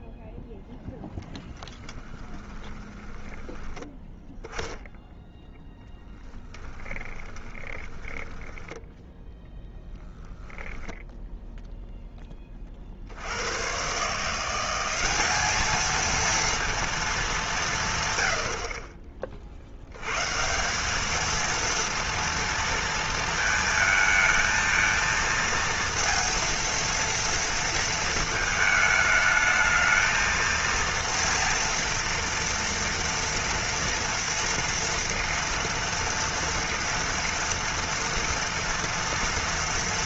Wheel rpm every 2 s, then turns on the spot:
0, 20, 10, 10, 10, 10, 20, 170, 230, 80, 160, 230, 220, 230, 220, 230, 230, 230, 230, 230.
2-4 6-10